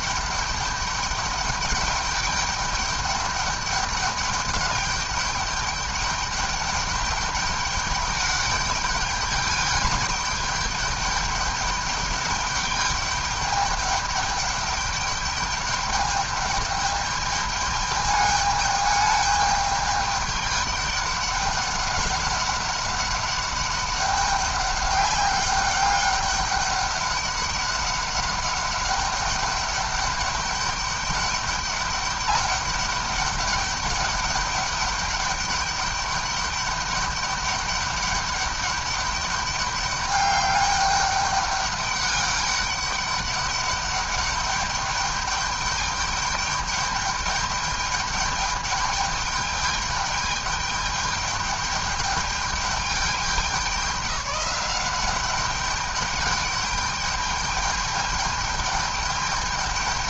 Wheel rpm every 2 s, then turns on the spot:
210, 200, 200, 210, 210, 210, 200, 210, 210, 210, 200, 190, 200, 200, 200, 200, 200, 200, 200, 200, 200, 200, 200, 210, 210, 210, 200, 190, 200, 210.
none